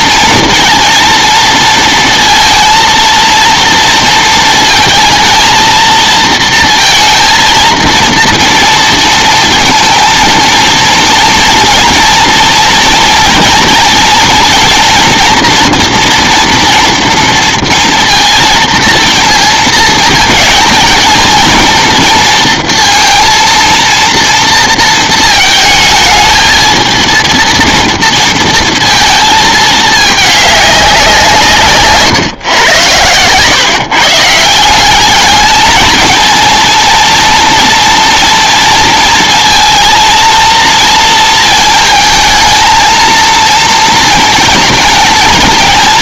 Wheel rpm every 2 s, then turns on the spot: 230, 230, 220, 230, 230, 230, 230, 230, 230, 230, 220, 230, 230, 220, 230, 200, 120, 170, 220, 230, 230, 220, 220.
none